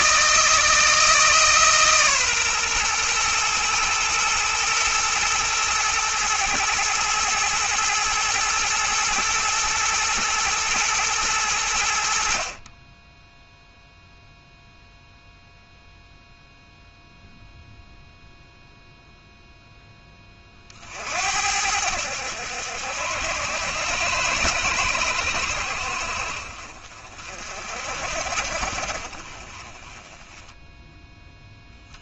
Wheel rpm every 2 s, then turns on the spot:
160, 120, 120, 110, 120, 110, 20, 0, 0, 0, 60, 80, 100, 50, 40, 0.
none